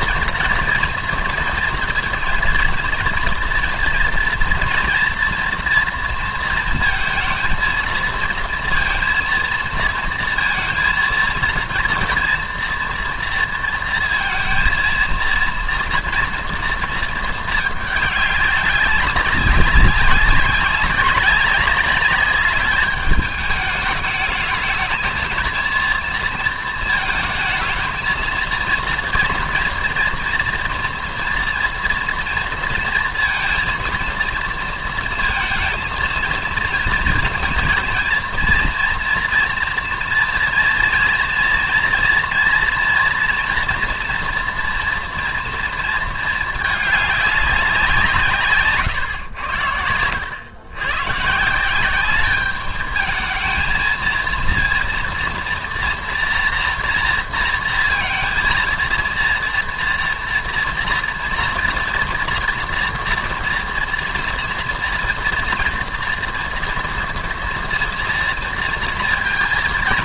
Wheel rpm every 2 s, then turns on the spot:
230, 230, 230, 230, 230, 230, 230, 230, 230, 200, 190, 200, 210, 230, 230, 240, 230, 230, 230, 230, 230, 240, 230, 220, 140, 100, 210, 230, 230, 230, 230, 240, 230, 230, 230.
none